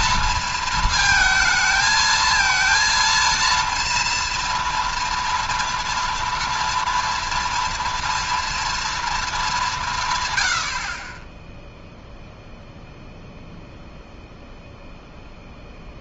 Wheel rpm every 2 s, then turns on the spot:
230, 230, 230, 230, 230, 80, 0, 0.
none